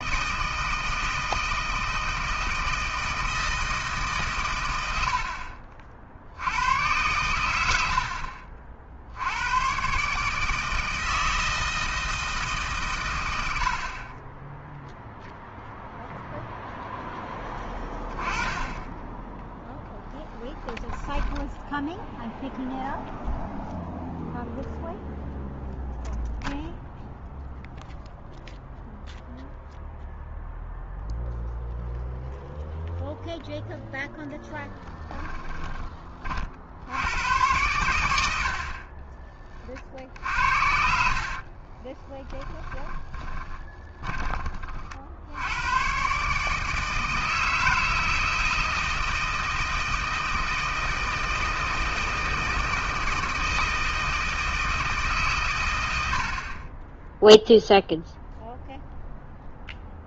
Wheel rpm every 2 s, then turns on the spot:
160, 160, 100, 100, 60, 160, 130, 0, 0, 20, 10, 0, 0, 0, 0, 0, 0, 10, 70, 60, 60, 20, 50, 160, 160, 160, 160, 160, 20, 0.
20-22 34-36 40-44